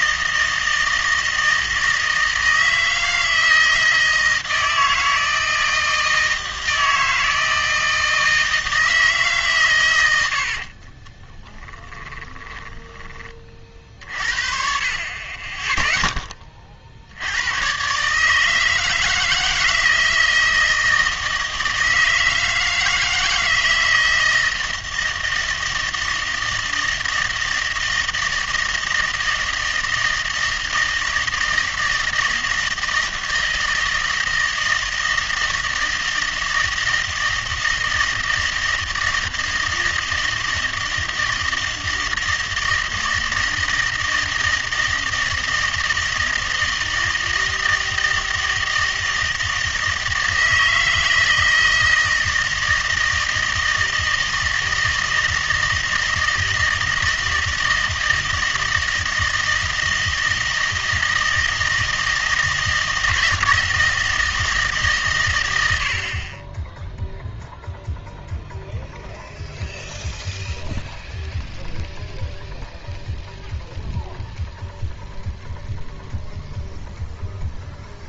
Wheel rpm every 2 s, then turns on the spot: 160, 160, 160, 160, 160, 40, 20, 40, 30, 160, 160, 160, 160, 160, 160, 160, 160, 160, 160, 160, 160, 160, 160, 160, 160, 160, 160, 160, 160, 160, 160, 160, 140, 10, 0, 0, 0, 0, 0.
10-14